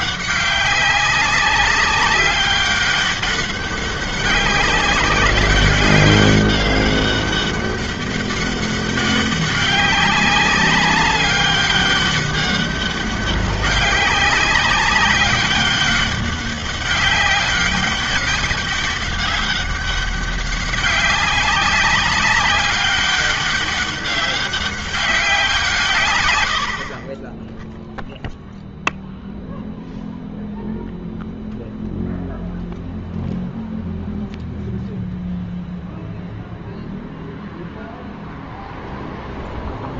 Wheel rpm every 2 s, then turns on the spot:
200, 200, 190, 200, 200, 190, 200, 190, 200, 200, 190, 200, 190, 80, 0, 0, 0, 0, 0, 0.
none